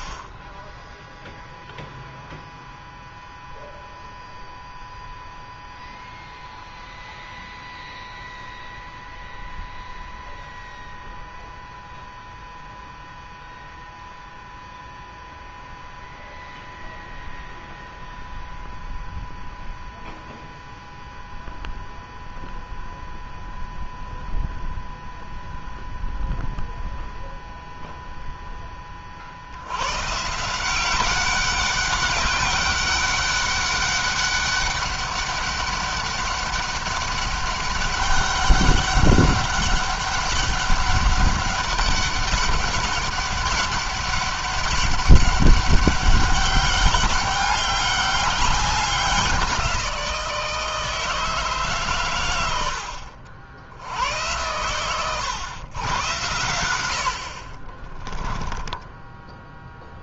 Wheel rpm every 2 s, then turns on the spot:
0, 0, 0, 0, 0, 0, 0, 0, 0, 0, 0, 0, 0, 0, 20, 180, 200, 200, 200, 200, 200, 200, 200, 200, 190, 160, 90, 110, 90, 10.
58-60